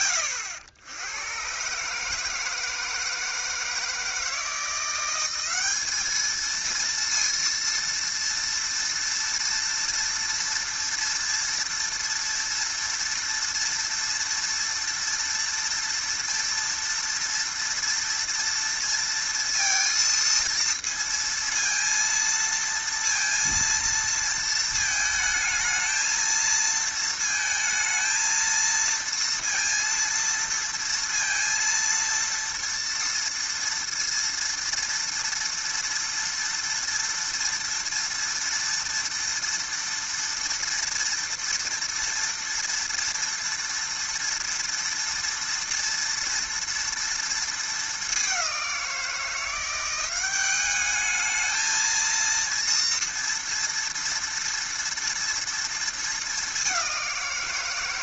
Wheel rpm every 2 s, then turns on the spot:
90, 160, 180, 230, 230, 230, 230, 230, 230, 230, 230, 230, 220, 220, 230, 230, 230, 230, 230, 230, 230, 230, 230, 230, 180, 200, 230, 230, 190.
none